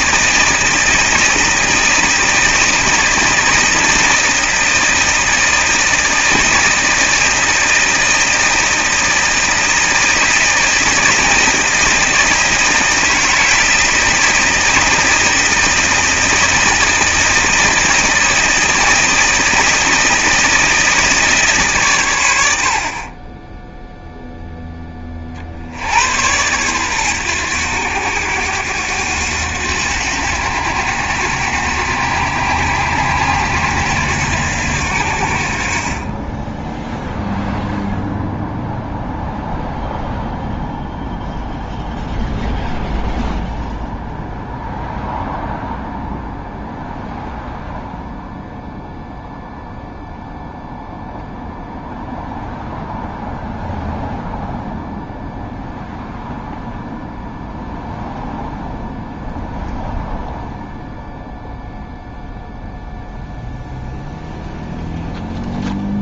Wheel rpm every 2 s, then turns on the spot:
160, 160, 160, 160, 160, 160, 160, 160, 160, 160, 160, 60, 10, 110, 90, 90, 90, 80, 10, 0, 0, 0, 0, 0, 0, 0, 0, 0, 0, 0, 0, 0, 0.
none